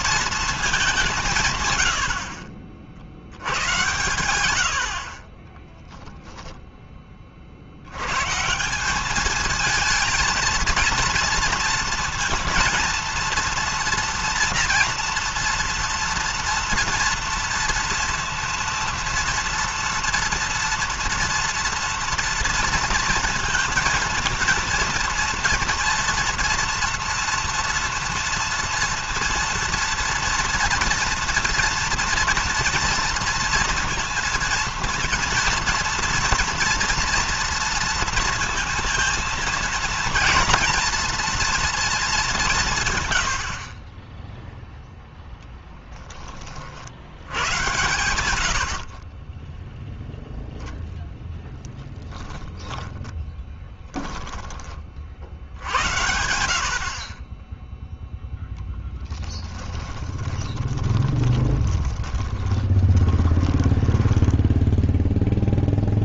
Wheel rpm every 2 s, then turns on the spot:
190, 50, 50, 10, 180, 230, 230, 230, 230, 230, 240, 230, 230, 230, 230, 230, 230, 230, 230, 230, 230, 140, 0, 70, 40, 0, 10, 40, 60, 10, 20, 20, 10.
52-54 60-66